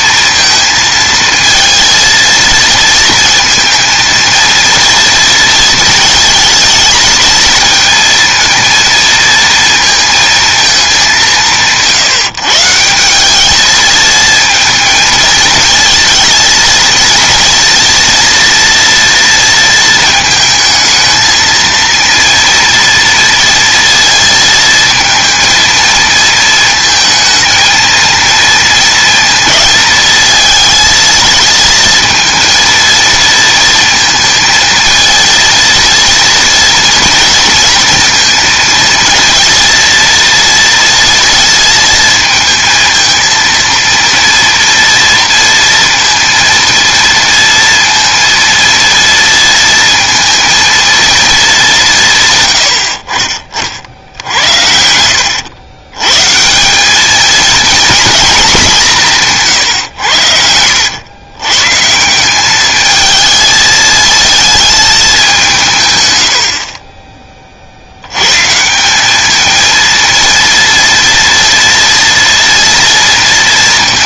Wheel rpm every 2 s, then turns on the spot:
230, 230, 230, 230, 230, 210, 170, 220, 230, 230, 220, 230, 220, 220, 230, 220, 230, 230, 230, 230, 230, 220, 230, 230, 230, 230, 80, 70, 190, 190, 90, 210, 220, 30, 170, 230, 230.
none